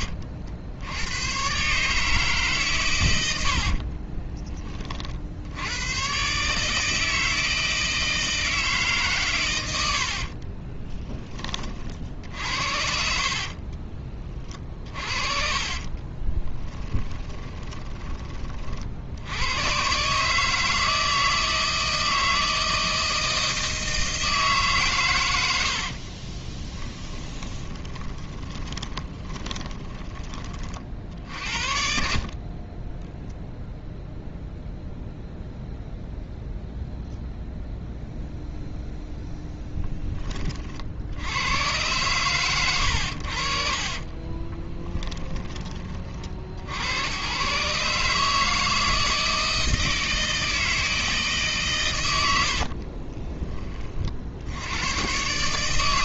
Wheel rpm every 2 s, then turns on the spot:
70, 130, 20, 160, 150, 30, 60, 40, 20, 50, 160, 160, 140, 10, 20, 40, 20, 0, 0, 0, 40, 110, 20, 80, 160, 160, 60, 90.
10-12 14-18 26-30 44-46 52-54